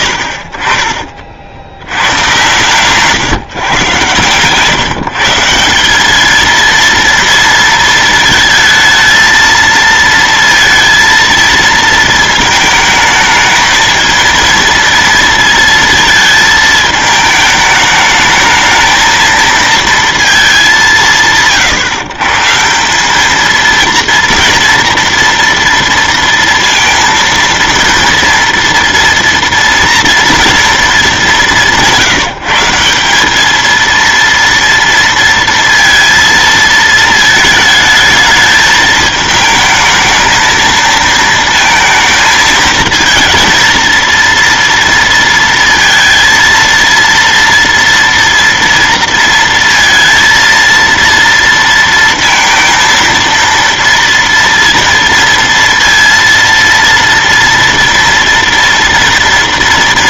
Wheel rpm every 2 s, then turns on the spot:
60, 130, 140, 230, 220, 230, 220, 230, 220, 220, 120, 170, 230, 230, 240, 230, 170, 230, 220, 220, 220, 220, 230, 230, 230, 230, 230, 230, 230, 230.
none